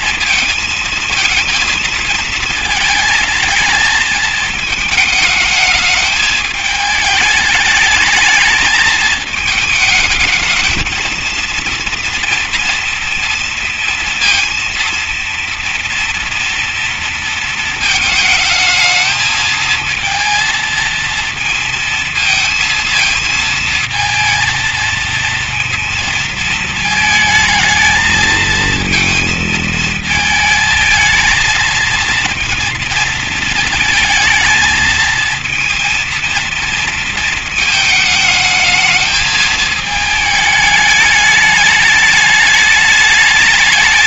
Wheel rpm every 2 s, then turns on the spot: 230, 220, 210, 220, 220, 220, 230, 230, 230, 220, 230, 230, 230, 220, 230, 220, 230, 220, 230, 220, 220, 210.
none